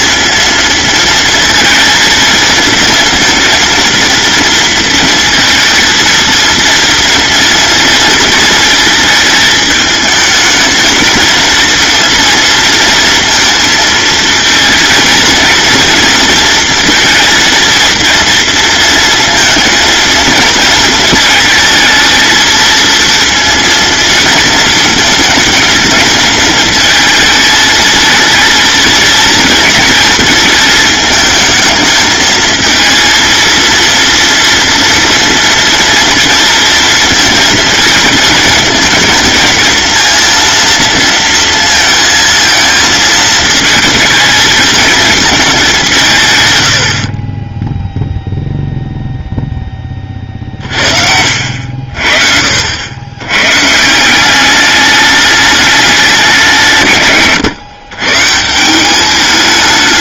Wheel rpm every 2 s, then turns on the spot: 230, 230, 230, 230, 220, 220, 230, 230, 230, 230, 220, 230, 220, 220, 230, 220, 220, 230, 230, 220, 230, 230, 220, 80, 0, 50, 70, 200, 140, 190.
none